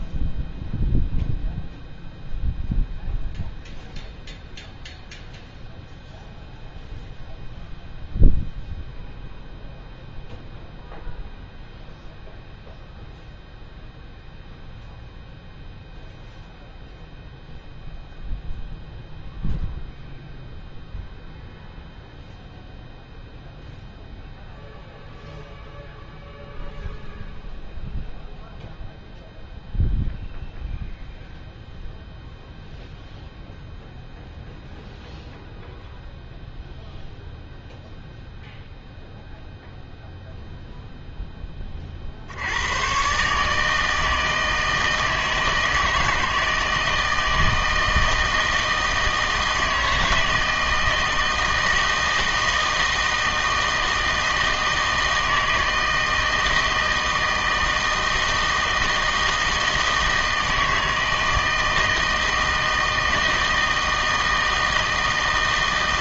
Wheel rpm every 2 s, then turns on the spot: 0, 0, 0, 0, 0, 0, 0, 0, 0, 0, 0, 0, 0, 0, 0, 0, 0, 0, 0, 0, 0, 110, 160, 160, 160, 160, 160, 160, 160, 160, 160, 160, 160.
none